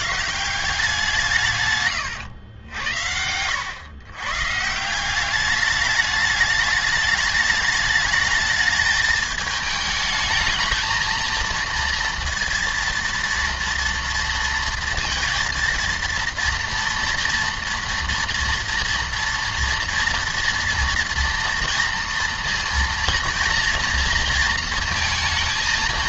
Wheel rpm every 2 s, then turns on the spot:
180, 100, 160, 210, 220, 220, 230, 230, 230, 230, 230, 230, 230.
2-4